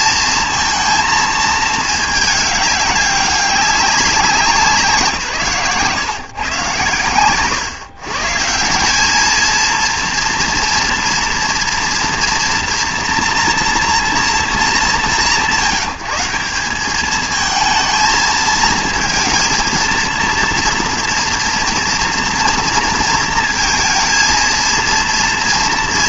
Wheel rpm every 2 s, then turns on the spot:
230, 210, 180, 130, 160, 230, 230, 210, 190, 230, 230, 230, 230.
none